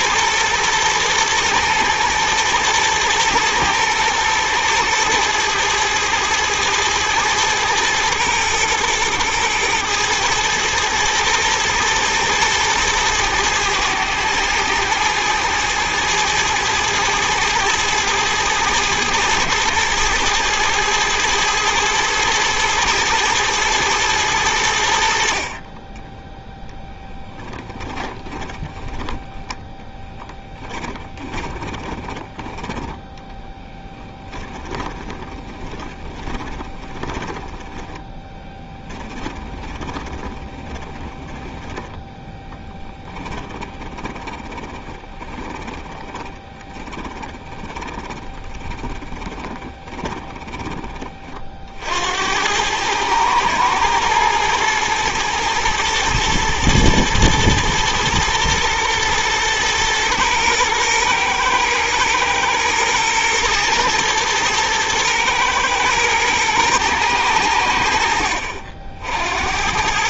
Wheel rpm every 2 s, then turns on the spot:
110, 110, 110, 110, 110, 110, 110, 110, 110, 110, 110, 110, 70, 10, 10, 20, 10, 20, 20, 20, 20, 20, 30, 20, 20, 20, 100, 120, 110, 120, 120, 120, 110, 110, 60.
28-32 34-50